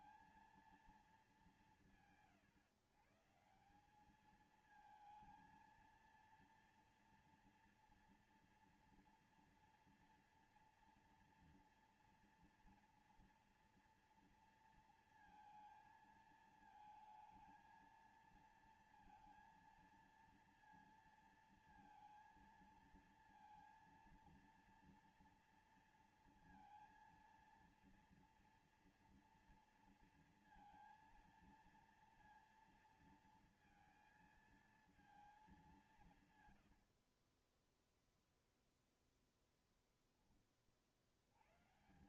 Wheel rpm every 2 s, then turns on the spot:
230, 150, 180, 230, 230, 230, 230, 230, 230, 230, 230, 230, 230, 230, 230, 230, 230, 230, 180, 10, 10.
none